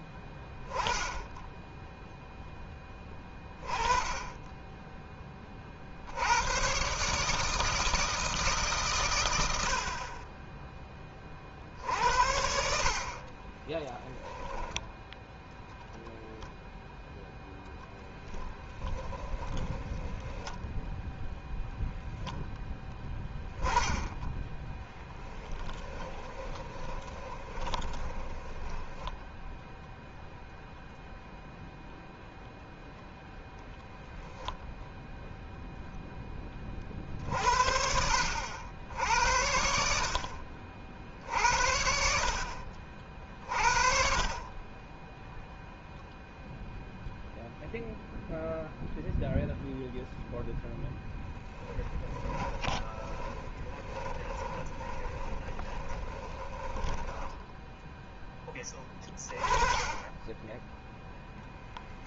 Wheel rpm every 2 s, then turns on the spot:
10, 10, 20, 130, 150, 30, 70, 0, 0, 10, 10, 0, 10, 20, 10, 0, 0, 0, 30, 70, 60, 50, 20, 0, 0, 10, 20, 20, 10, 10, 10.
18-22 24-30 52-58